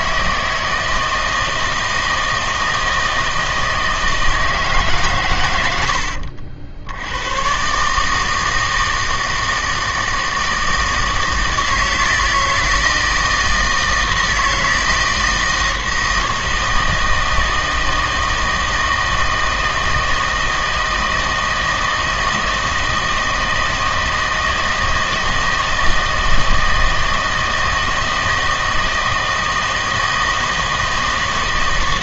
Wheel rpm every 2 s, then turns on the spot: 160, 160, 150, 70, 160, 160, 160, 160, 160, 160, 160, 160, 160, 160, 160, 160.
none